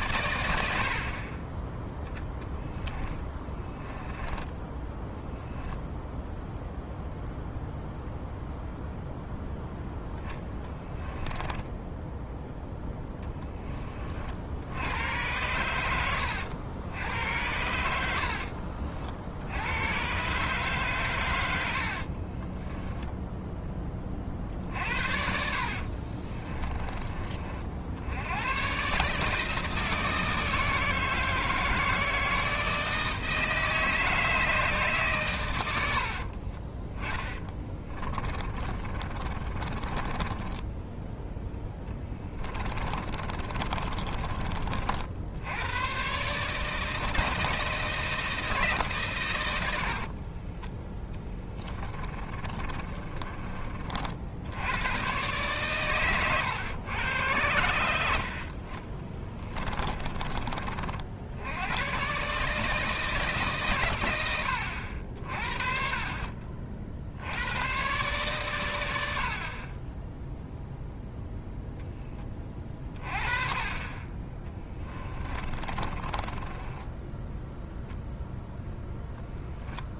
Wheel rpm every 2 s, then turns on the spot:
60, 10, 10, 0, 0, 10, 10, 90, 90, 60, 140, 20, 80, 20, 130, 160, 160, 140, 20, 30, 10, 30, 40, 160, 140, 10, 30, 110, 110, 20, 50, 160, 70, 50, 90, 0, 30, 20, 10, 0.
0-6 10-12 22-24 36-40 42-44 50-54 58-60 74-78